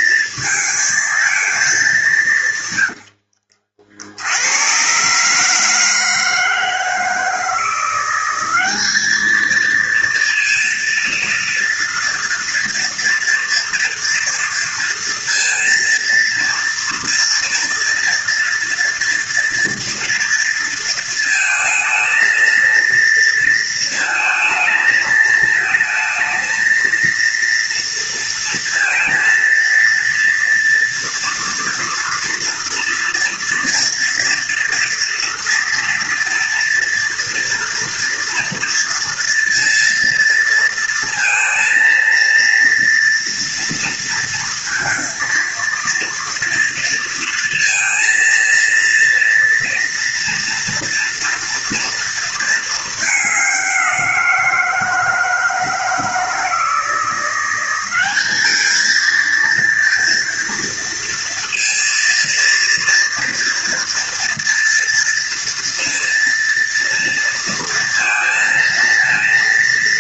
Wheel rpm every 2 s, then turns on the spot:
220, 100, 110, 160, 200, 230, 230, 230, 230, 230, 230, 230, 220, 230, 230, 230, 240, 230, 230, 230, 230, 230, 230, 230, 230, 230, 220, 160, 170, 220, 230, 230, 230, 230, 230.
2-4